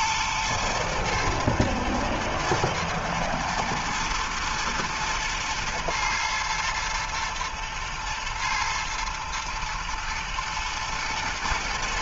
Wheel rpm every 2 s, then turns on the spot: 110, 110, 120, 110, 110, 120.
none